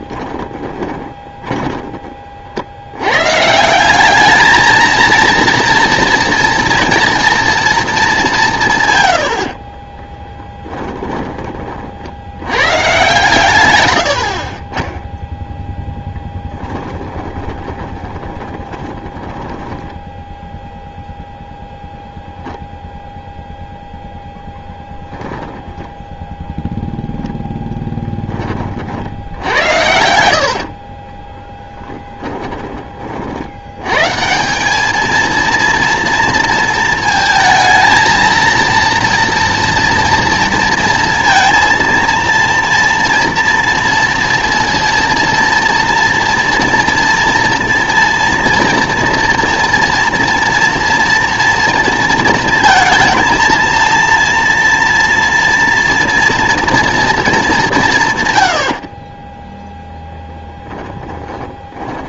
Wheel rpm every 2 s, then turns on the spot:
20, 50, 230, 230, 140, 10, 110, 40, 20, 20, 0, 0, 0, 0, 40, 40, 30, 190, 220, 230, 230, 230, 230, 230, 230, 230, 230, 230, 230, 70, 10.
0-2 10-12 16-20 30-32 60-62